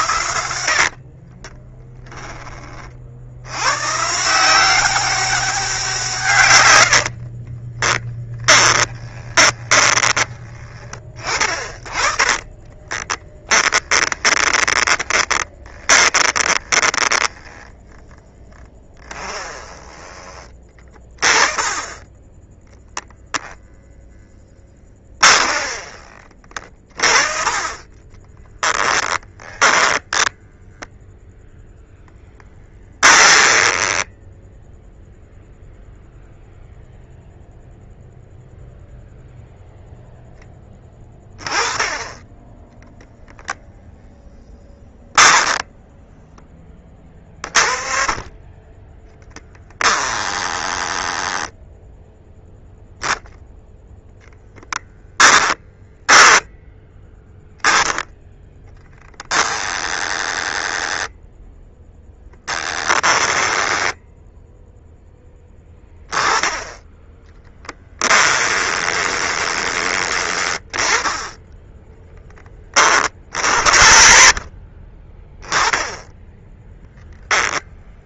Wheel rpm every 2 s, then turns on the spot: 70, 40, 190, 100, 20, 20, 20, 20, 10, 20, 20, 0, 20, 30, 10, 0, 10, 0, 0, 0, 20, 10, 10, 30, 20, 10, 0, 10, 10, 10, 10, 10, 10, 10, 20, 30, 30, 30, 10.
0-2 6-20 24-26 28-30 32-34 54-56 62-64 68-70 76-78